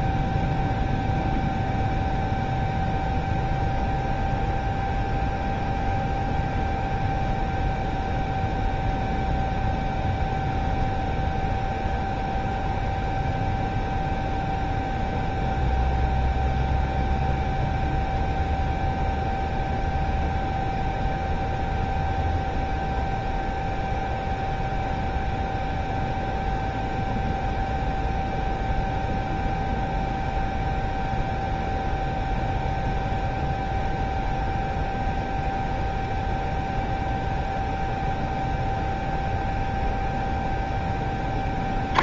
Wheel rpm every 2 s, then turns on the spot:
0, 0, 0, 0, 0, 0, 0, 0, 0, 0, 0, 0, 0, 0, 0, 0, 0, 0, 0, 0, 0.
none